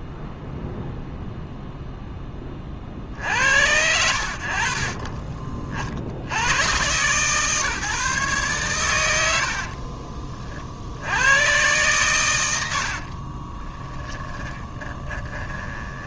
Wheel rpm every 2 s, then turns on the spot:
0, 30, 50, 100, 120, 50, 80, 20.
12-16